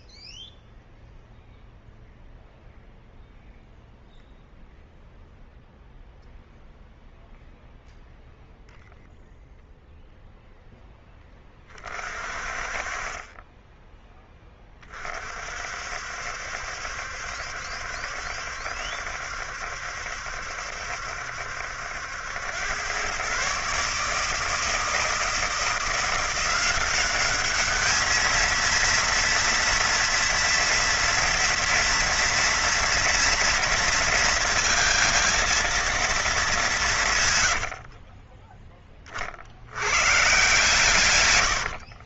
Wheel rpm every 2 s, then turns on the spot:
0, 0, 0, 0, 0, 0, 40, 20, 70, 70, 70, 90, 150, 180, 220, 230, 230, 230, 210, 20, 150.
38-40